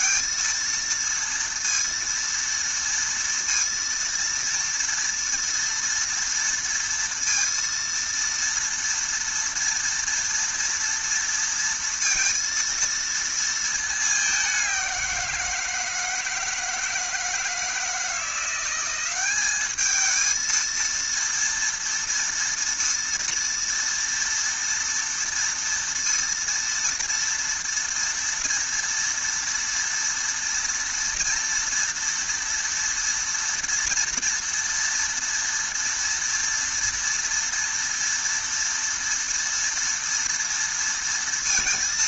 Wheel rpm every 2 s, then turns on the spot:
230, 230, 230, 230, 230, 230, 230, 180, 160, 190, 230, 230, 230, 230, 230, 230, 230, 230, 240, 230, 230.
none